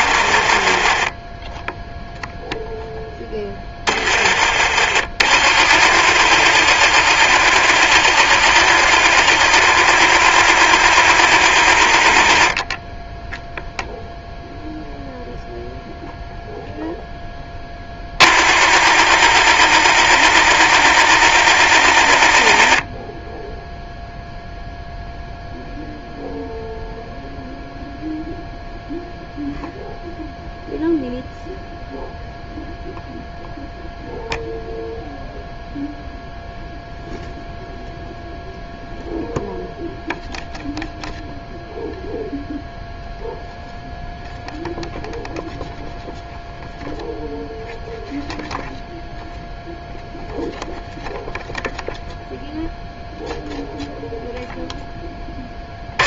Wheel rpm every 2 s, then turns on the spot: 30, 0, 30, 40, 40, 40, 10, 0, 0, 40, 40, 20, 0, 0, 0, 0, 0, 0, 0, 0, 0, 0, 0, 0, 0, 0, 0, 10.
0-2